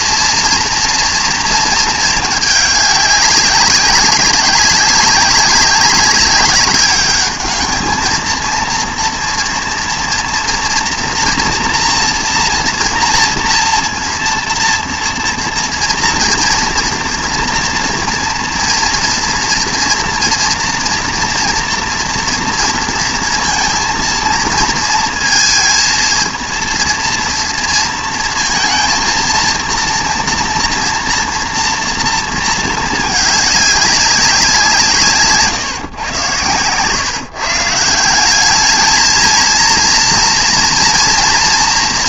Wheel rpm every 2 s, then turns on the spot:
230, 210, 190, 210, 230, 240, 230, 230, 230, 230, 230, 230, 230, 230, 230, 240, 220, 170, 120, 210, 230.
36-38